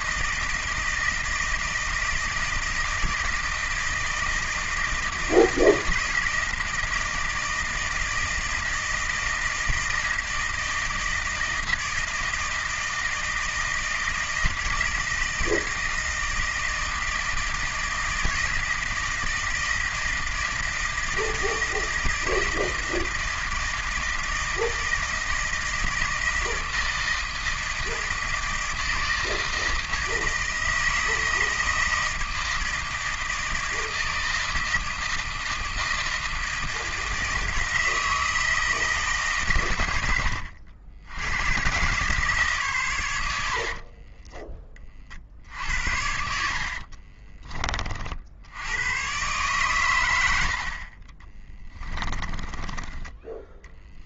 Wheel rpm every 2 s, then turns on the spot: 160, 160, 160, 160, 160, 160, 160, 160, 160, 160, 160, 160, 160, 160, 160, 160, 160, 160, 160, 160, 80, 130, 20, 70, 80, 60, 20.
46-48 52-54